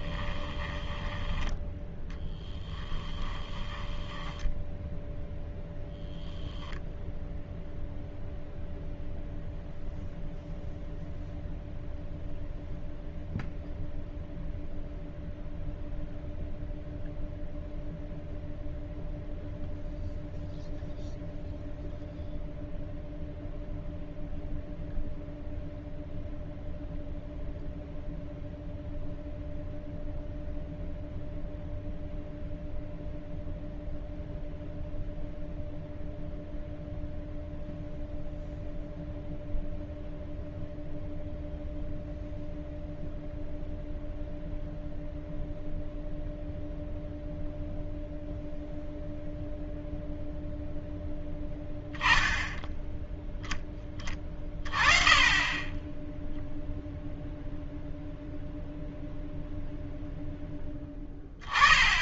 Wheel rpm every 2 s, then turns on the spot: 10, 10, 10, 0, 0, 0, 0, 0, 0, 0, 0, 0, 0, 0, 0, 0, 0, 0, 0, 0, 0, 0, 0, 0, 0, 0, 0, 20, 0, 0, 0.
0-6